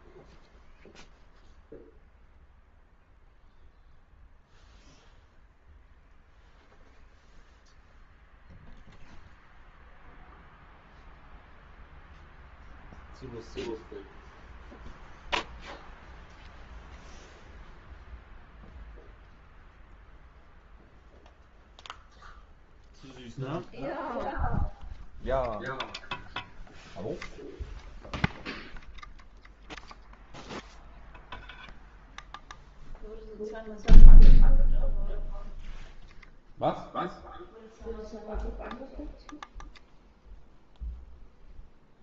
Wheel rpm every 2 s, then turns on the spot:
0, 0, 0, 0, 0, 0, 0, 0, 0, 0, 0, 0, 0, 0, 0, 0, 0, 0, 0, 0, 0.
none